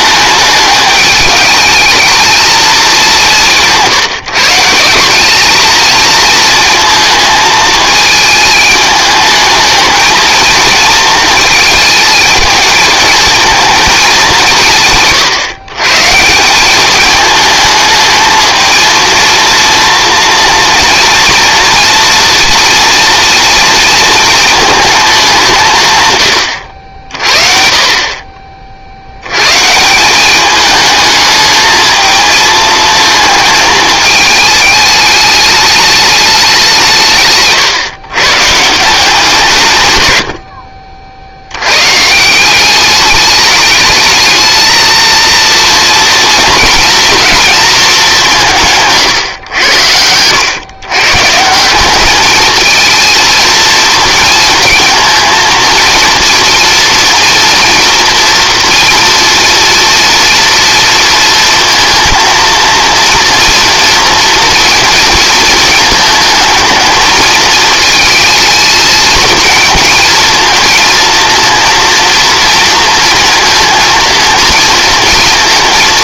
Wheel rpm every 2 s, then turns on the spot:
210, 210, 170, 220, 210, 220, 220, 160, 200, 220, 230, 230, 220, 80, 50, 210, 220, 210, 170, 160, 60, 190, 220, 240, 150, 120, 220, 230, 240, 230, 230, 230, 230, 220, 220, 230, 230, 230.
none